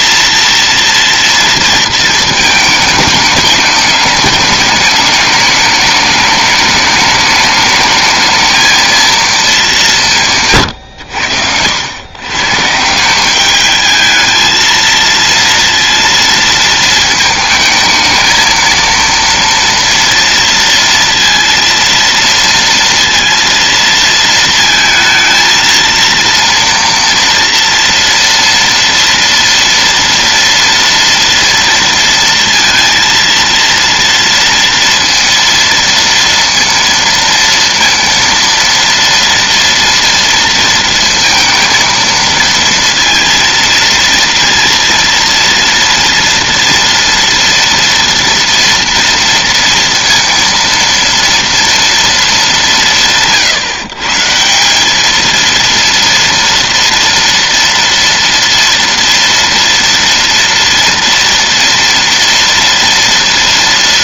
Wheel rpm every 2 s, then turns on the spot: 230, 220, 210, 210, 220, 150, 140, 220, 230, 220, 230, 230, 220, 230, 230, 230, 230, 230, 230, 230, 230, 230, 230, 230, 230, 230, 210, 160, 230, 230, 230, 230.
none